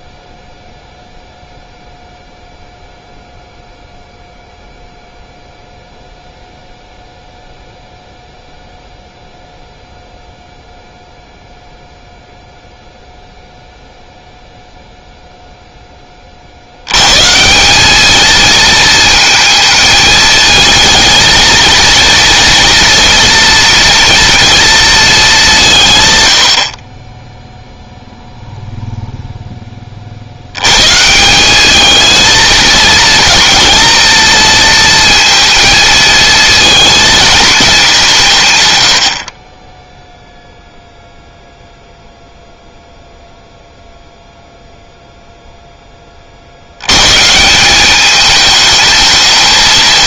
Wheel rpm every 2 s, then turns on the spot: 0, 0, 0, 0, 0, 0, 0, 0, 110, 220, 220, 240, 220, 20, 0, 140, 230, 230, 230, 90, 0, 0, 0, 130, 220.
none